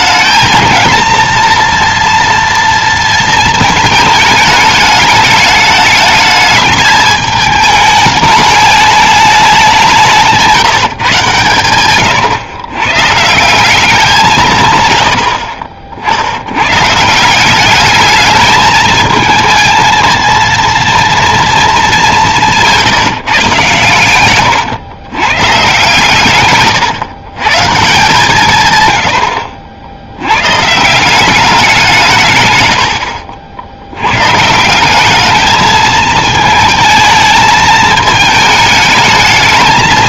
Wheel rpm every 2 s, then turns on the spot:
220, 230, 210, 220, 210, 160, 120, 150, 130, 220, 230, 170, 110, 120, 130, 140, 120, 160, 220, 210.
22-24 26-28